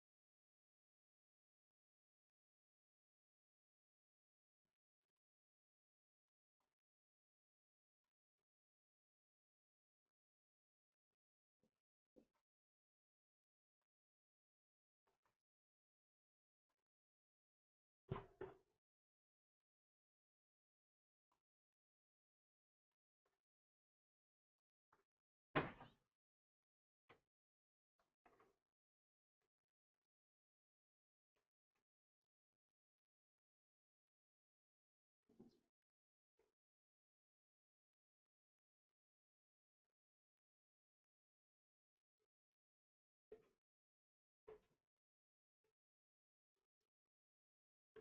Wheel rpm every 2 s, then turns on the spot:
0, 0, 0, 0, 0, 0, 0, 0, 0, 0, 0, 0, 0, 0, 0, 0, 0, 0, 0, 0, 0, 0, 0, 0.
none